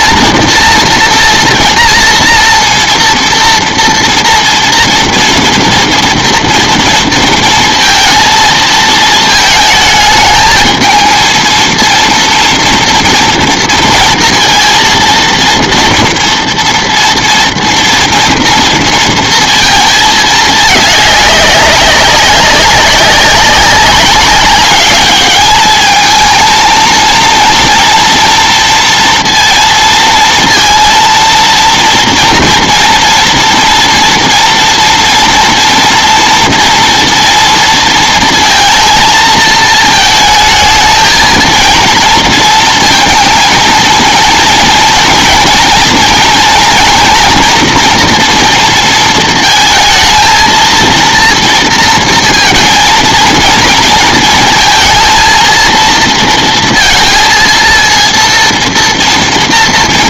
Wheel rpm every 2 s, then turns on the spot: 240, 240, 230, 230, 220, 220, 230, 230, 230, 230, 210, 190, 210, 230, 230, 230, 230, 230, 230, 220, 220, 230, 230, 240, 230, 230, 230, 220, 230, 230.
none